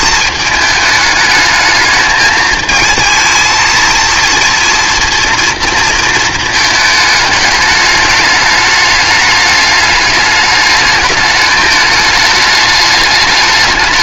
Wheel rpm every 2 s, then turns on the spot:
220, 220, 230, 220, 210, 210, 210.
none